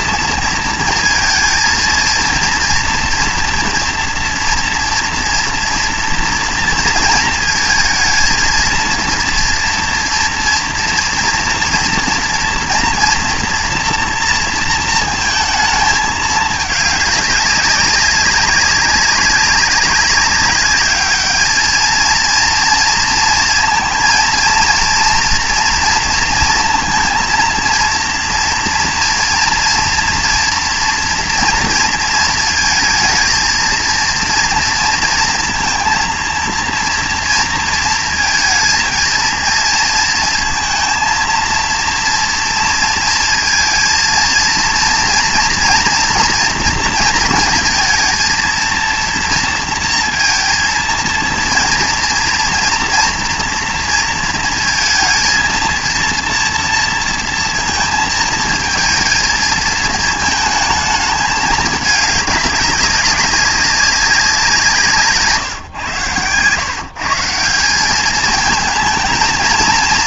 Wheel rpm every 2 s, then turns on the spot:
230, 230, 240, 230, 230, 240, 230, 230, 210, 200, 200, 230, 230, 230, 230, 230, 230, 230, 230, 230, 230, 230, 230, 230, 230, 230, 230, 230, 230, 230, 220, 200, 180, 130, 220.
none